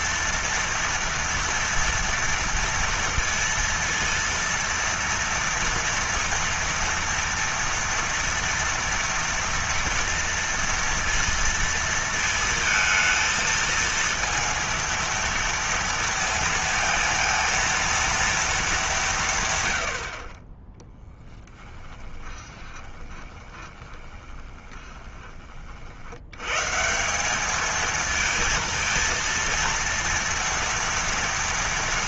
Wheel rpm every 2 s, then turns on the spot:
230, 230, 230, 230, 230, 230, 220, 230, 230, 220, 40, 20, 20, 110, 220, 230.
22-26